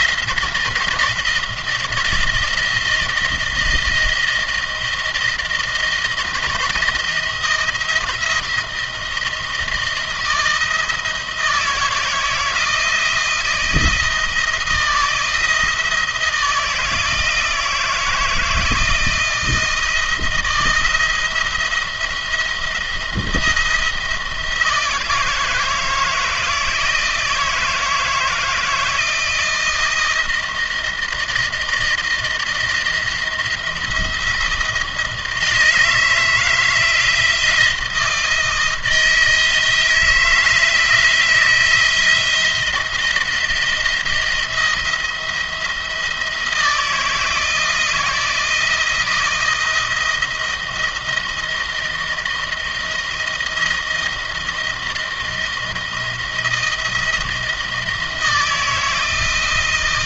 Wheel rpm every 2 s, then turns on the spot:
170, 160, 170, 160, 160, 160, 160, 170, 160, 160, 170, 170, 160, 160, 160, 160, 170, 160, 160, 160, 160, 170, 170, 170, 160, 170, 170, 160, 170, 160.
none